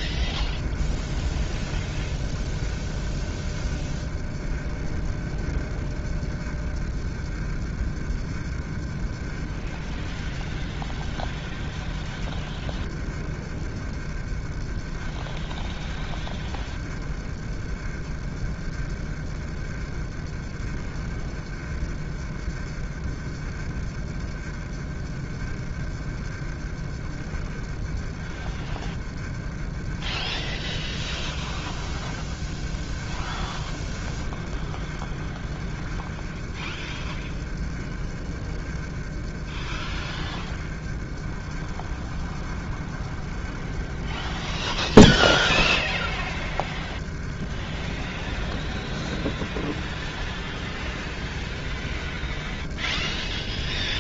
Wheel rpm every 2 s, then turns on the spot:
30, 30, 30, 30, 30, 30, 30, 30, 30, 30, 30, 30, 30, 30, 30, 30, 30, 30, 30, 30, 30, 30, 30, 30, 30, 30, 30.
none